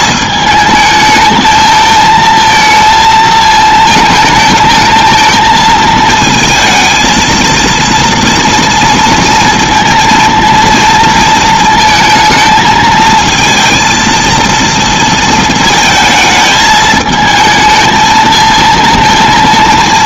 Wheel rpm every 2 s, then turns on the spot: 220, 230, 220, 220, 230, 230, 220, 230, 220, 220.
none